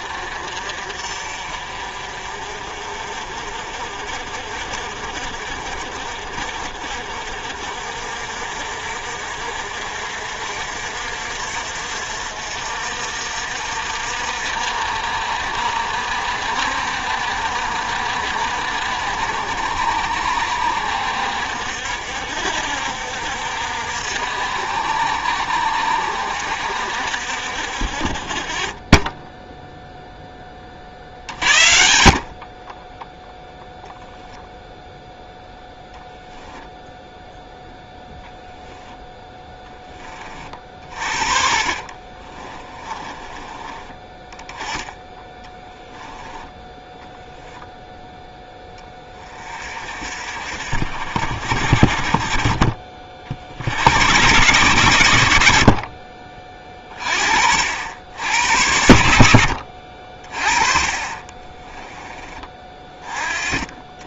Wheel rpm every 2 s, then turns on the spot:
50, 50, 50, 50, 50, 60, 60, 60, 60, 60, 60, 60, 60, 60, 20, 40, 10, 0, 0, 10, 40, 20, 20, 10, 20, 60, 40, 110, 40, 70, 30, 30.
42-46 60-62